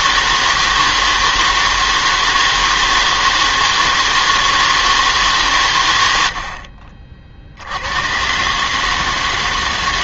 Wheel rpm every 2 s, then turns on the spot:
160, 160, 160, 50, 140.
none